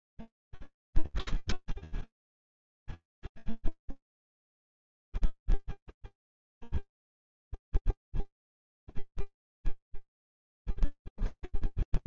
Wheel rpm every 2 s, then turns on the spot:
0, 0, 0, 0, 0, 0.
none